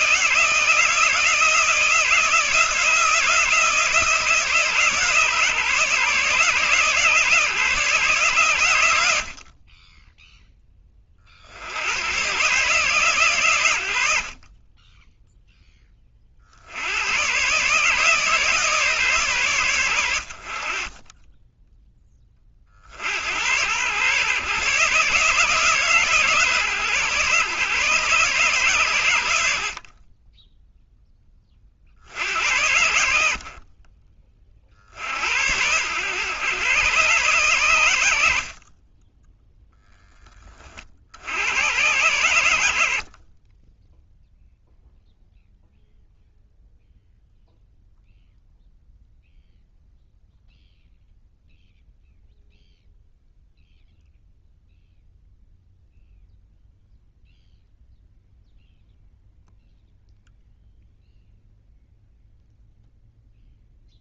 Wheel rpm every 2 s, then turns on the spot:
160, 170, 150, 150, 90, 20, 140, 10, 100, 140, 30, 70, 140, 140, 130, 10, 70, 60, 130, 30, 40, 60, 0, 0, 0, 0, 0, 0, 0, 0, 0, 0.
none